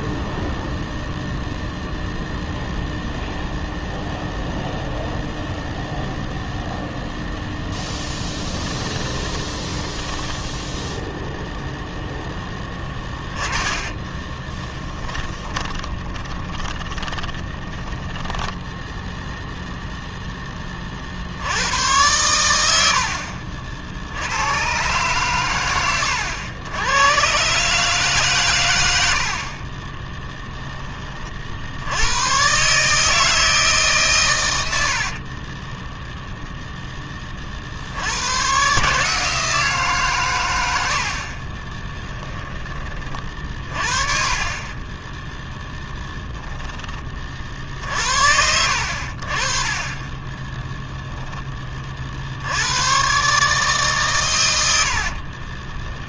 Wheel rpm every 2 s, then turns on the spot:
0, 0, 0, 0, 10, 10, 20, 20, 20, 0, 30, 90, 120, 100, 110, 10, 140, 70, 10, 140, 80, 20, 30, 20, 70, 10, 100, 80.
8-18 44-46